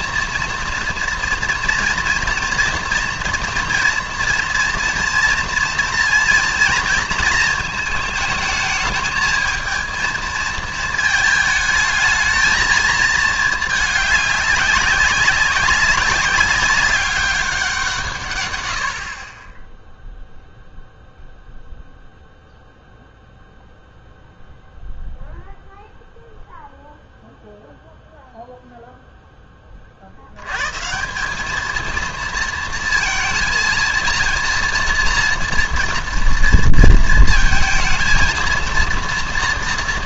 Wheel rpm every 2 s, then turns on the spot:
230, 240, 230, 230, 220, 220, 220, 200, 200, 90, 0, 0, 0, 0, 0, 140, 230, 230, 230, 230.
none